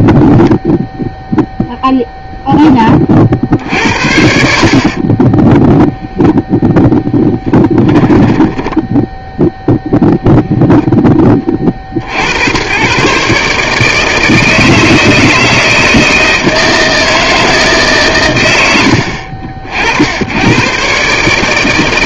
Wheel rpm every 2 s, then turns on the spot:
0, 20, 50, 0, 10, 10, 120, 160, 160, 90, 120.
4-6 8-10